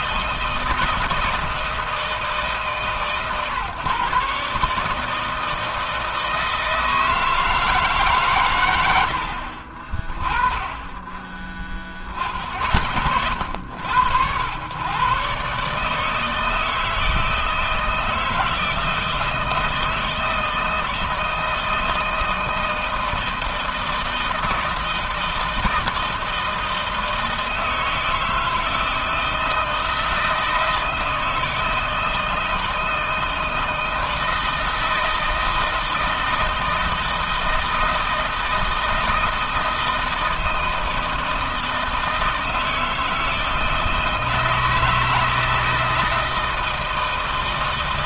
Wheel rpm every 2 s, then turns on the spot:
160, 140, 150, 160, 100, 10, 50, 120, 160, 160, 160, 160, 160, 160, 160, 160, 160, 160, 160, 160, 160, 160, 160, 160.
none